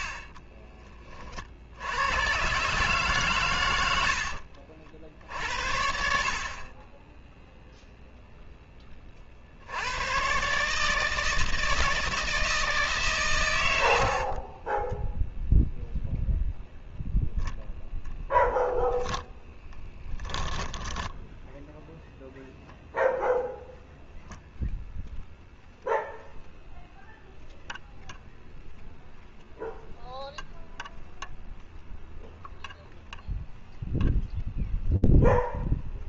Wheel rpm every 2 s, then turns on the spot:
30, 130, 60, 50, 0, 130, 160, 30, 0, 0, 10, 0, 0, 0, 0, 0, 0, 0.
0-2 4-6 14-16 20-22